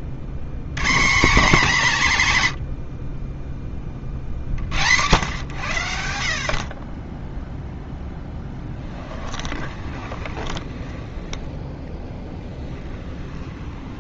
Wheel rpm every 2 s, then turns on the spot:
130, 80, 90, 40, 20, 30, 10.
8-14